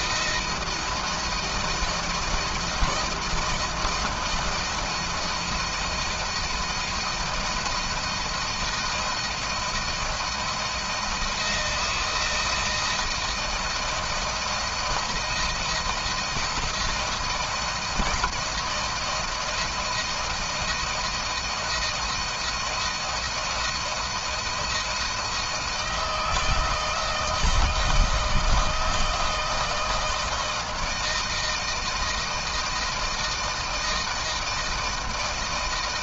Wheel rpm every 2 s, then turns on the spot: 160, 160, 160, 160, 160, 160, 160, 160, 170, 170, 160, 160, 160, 160, 160, 160, 160, 160.
none